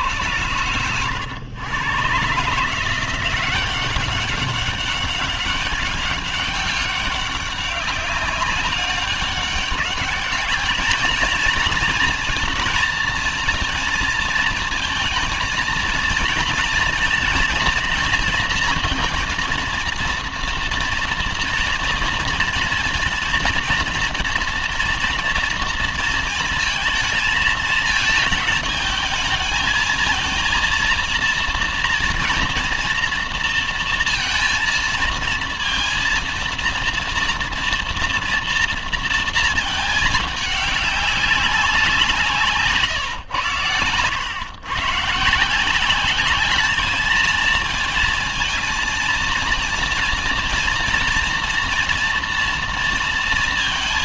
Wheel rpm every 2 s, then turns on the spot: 110, 150, 190, 200, 190, 210, 230, 230, 230, 230, 240, 240, 230, 230, 220, 230, 230, 230, 230, 230, 210, 150, 120, 200, 230, 230, 230.
none